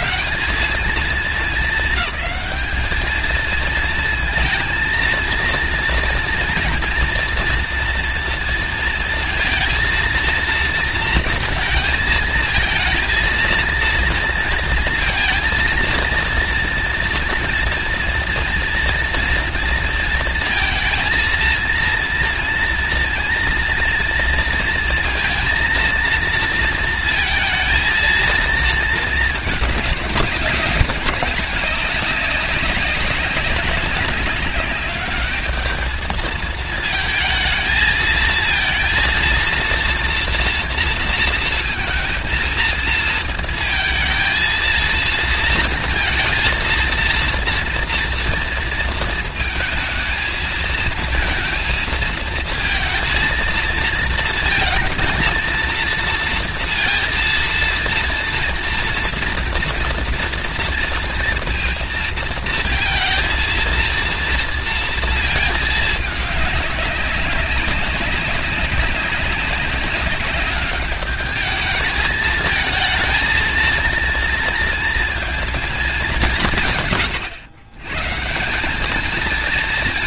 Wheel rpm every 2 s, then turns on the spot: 210, 220, 230, 230, 230, 230, 230, 230, 230, 230, 230, 230, 230, 230, 220, 190, 190, 200, 220, 230, 230, 230, 230, 230, 230, 230, 220, 220, 230, 230, 230, 230, 230, 210, 190, 200, 220, 230, 140, 180.
none